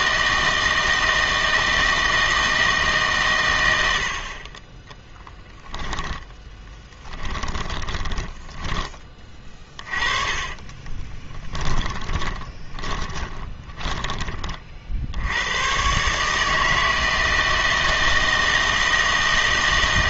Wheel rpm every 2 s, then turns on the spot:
160, 160, 20, 10, 10, 30, 20, 30, 160, 160.
6-8 10-14